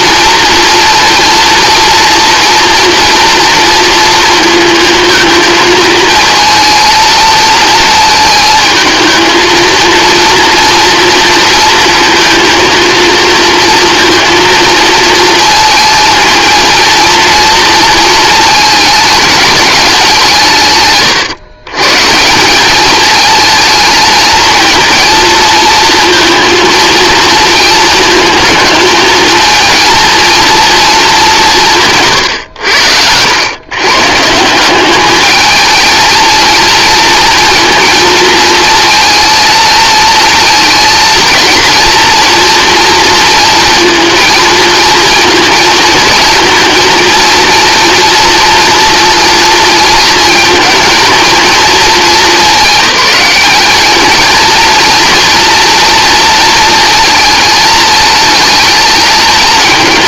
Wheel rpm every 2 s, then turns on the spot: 230, 230, 230, 230, 220, 230, 230, 230, 230, 220, 140, 200, 230, 230, 220, 220, 90, 190, 230, 230, 230, 230, 220, 230, 230, 220, 210, 230, 230, 220.
none